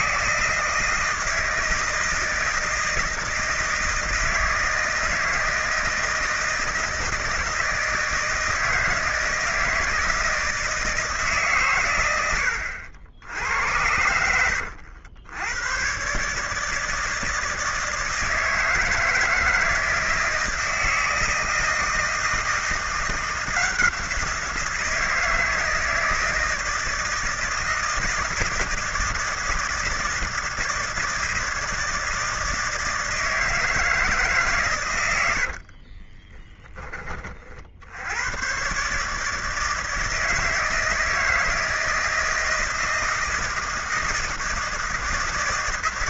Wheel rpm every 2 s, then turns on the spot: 160, 160, 160, 160, 160, 160, 80, 90, 150, 160, 160, 170, 170, 160, 160, 160, 160, 120, 20, 120, 160, 160, 160.
none